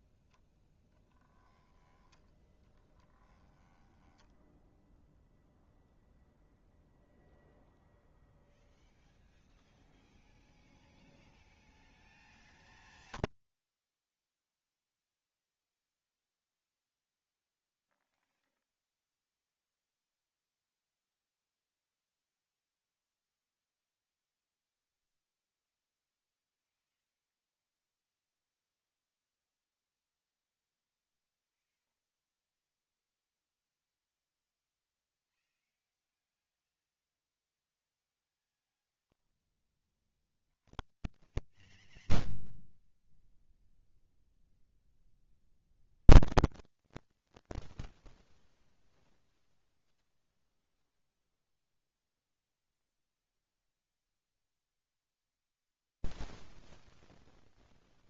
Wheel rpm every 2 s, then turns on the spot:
10, 10, 0, 0, 0, 0, 0, 0, 0, 0, 0, 0, 0, 0, 0, 0, 0, 0, 0, 0, 0, 0, 0, 0, 0, 0, 0, 0, 0.
2-4